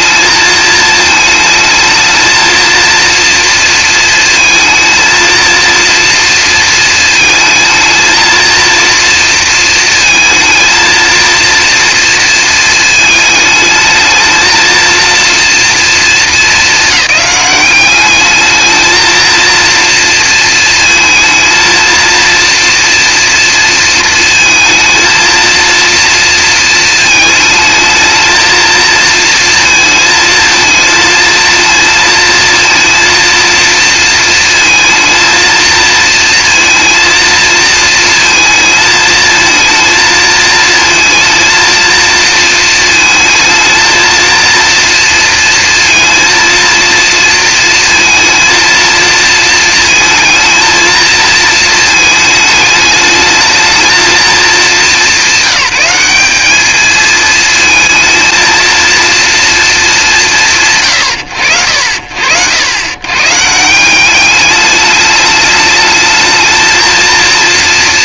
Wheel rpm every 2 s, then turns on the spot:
220, 230, 220, 230, 230, 230, 220, 220, 210, 220, 230, 230, 230, 230, 230, 230, 230, 230, 230, 220, 230, 230, 230, 230, 230, 230, 220, 200, 220, 230, 100, 90, 210, 230.
none